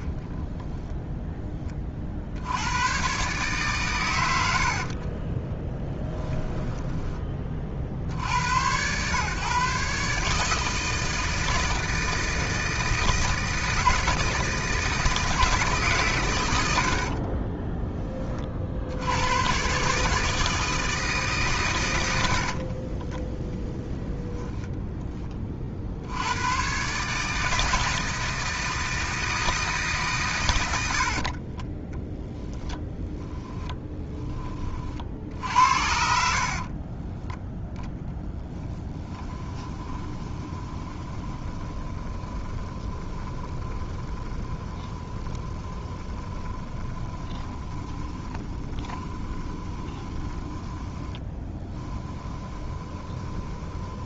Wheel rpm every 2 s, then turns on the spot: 0, 100, 60, 20, 110, 160, 160, 160, 80, 60, 160, 30, 10, 130, 160, 70, 10, 40, 30, 10, 20, 20, 20, 20, 20, 10, 20.
4-8 22-24 32-34 36-54